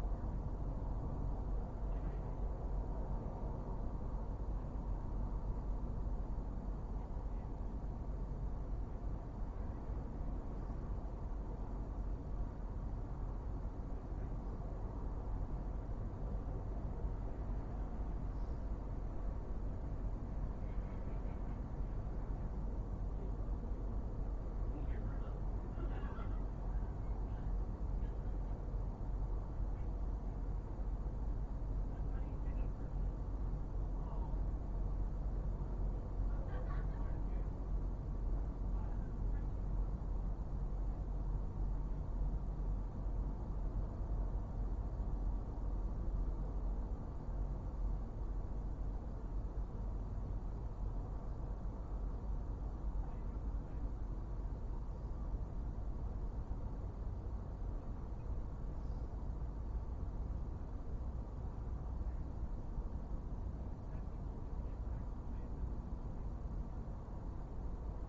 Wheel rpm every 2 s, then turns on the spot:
0, 0, 0, 0, 0, 0, 0, 0, 0, 0, 0, 0, 0, 0, 0, 0, 0, 0, 0, 0, 0, 0, 0, 0, 0, 0, 0, 0, 0, 0, 0, 0, 0, 0.
none